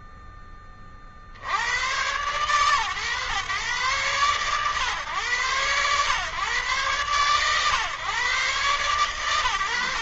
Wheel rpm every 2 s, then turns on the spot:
20, 100, 110, 120, 130.
none